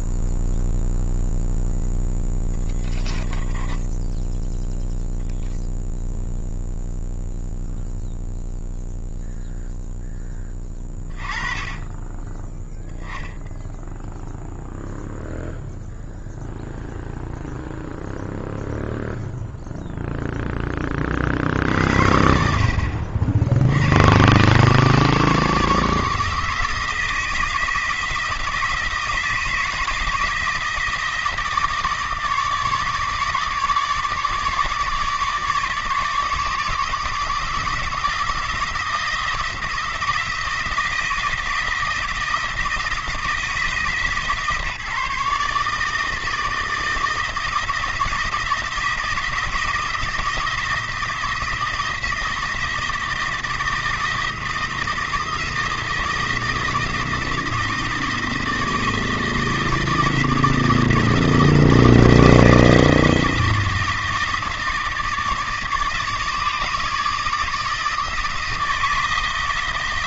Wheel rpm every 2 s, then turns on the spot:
0, 0, 10, 0, 0, 10, 10, 0, 0, 0, 10, 60, 140, 160, 160, 160, 150, 150, 150, 170, 170, 160, 160, 160, 160, 160, 160, 170, 160, 160, 170, 160, 160, 160, 160.
none